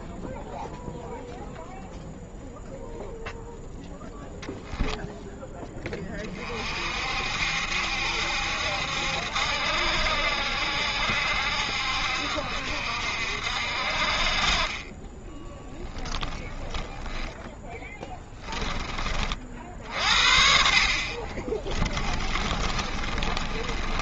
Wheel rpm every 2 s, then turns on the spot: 0, 0, 0, 50, 70, 70, 60, 30, 10, 20, 50, 30.
16-18 22-24